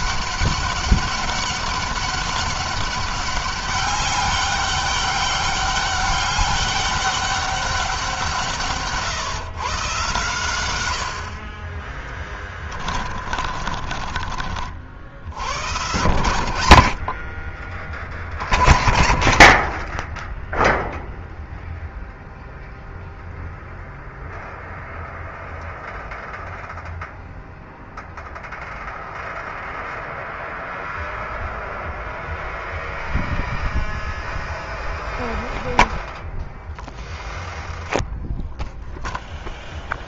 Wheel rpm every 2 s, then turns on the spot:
200, 200, 200, 200, 150, 90, 30, 50, 80, 30, 0, 0, 0, 0, 0, 0, 0, 0, 0, 0.
12-14